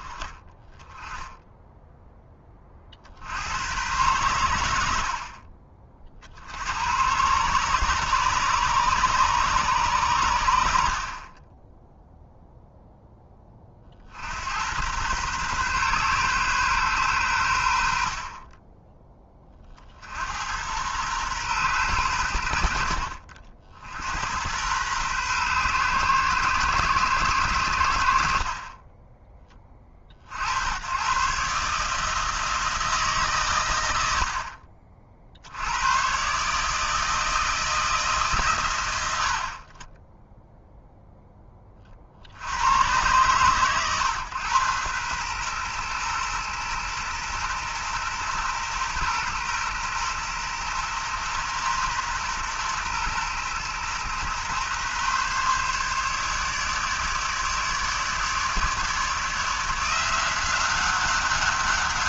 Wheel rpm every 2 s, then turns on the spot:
10, 30, 80, 90, 140, 80, 0, 100, 130, 10, 100, 80, 100, 120, 30, 90, 160, 50, 150, 110, 0, 100, 120, 120, 120, 120, 120, 130, 150, 150, 190.
none